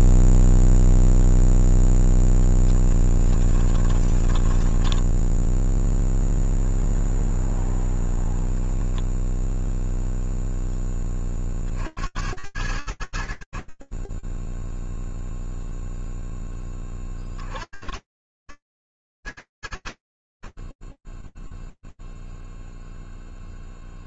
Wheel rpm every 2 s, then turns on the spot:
0, 10, 10, 0, 0, 10, 90, 10, 10, 90, 60, 0.
2-6